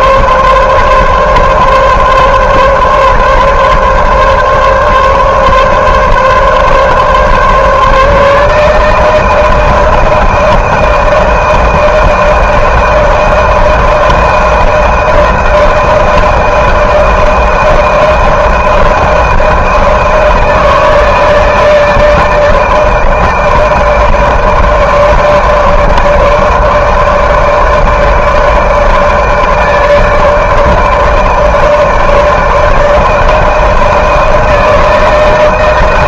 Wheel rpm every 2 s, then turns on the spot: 140, 140, 140, 140, 150, 160, 160, 160, 160, 160, 160, 160, 160, 160, 150, 150, 160, 160.
none